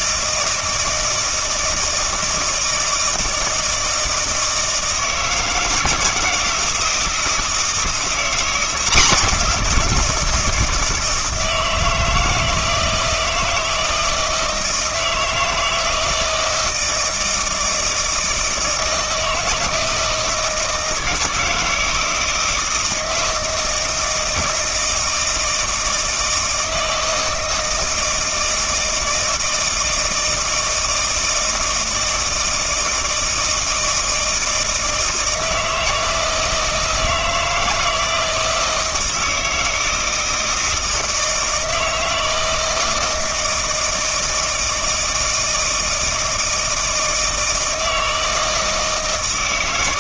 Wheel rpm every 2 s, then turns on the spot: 160, 160, 160, 160, 180, 160, 160, 160, 160, 160, 160, 160, 160, 160, 160, 160, 160, 160, 160, 160, 160, 160, 160, 160, 160.
none